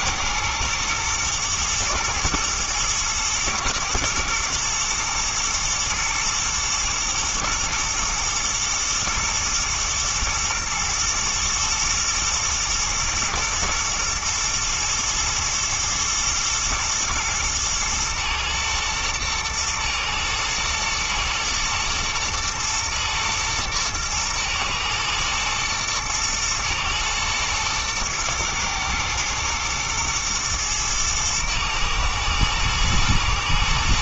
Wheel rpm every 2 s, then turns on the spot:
110, 110, 120, 110, 110, 110, 120, 120, 110, 110, 110, 110, 110, 120, 110, 110, 110.
none